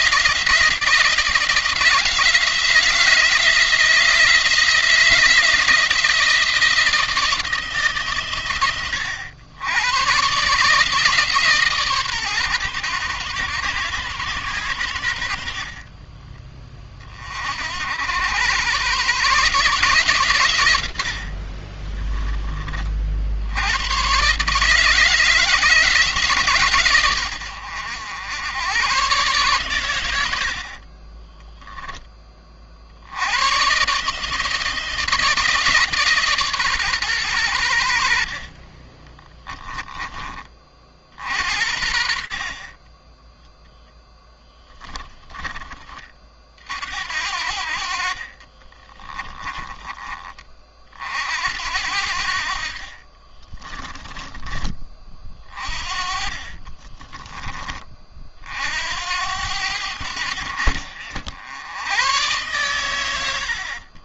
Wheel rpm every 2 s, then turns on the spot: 170, 170, 170, 160, 110, 150, 120, 90, 30, 130, 100, 40, 150, 120, 120, 50, 60, 160, 130, 30, 50, 20, 10, 60, 40, 50, 40, 30, 20, 70, 70, 100.
30-32 38-40 48-50 52-54 56-58